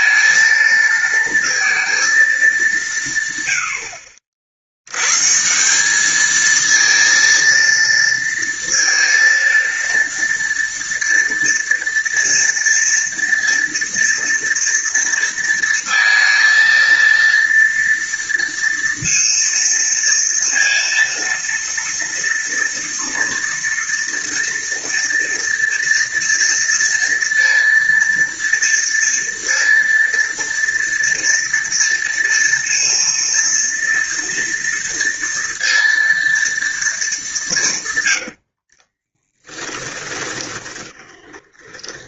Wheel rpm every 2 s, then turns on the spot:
230, 210, 60, 220, 230, 230, 230, 230, 230, 230, 230, 230, 230, 230, 230, 230, 230, 230, 230, 100, 20.
38-42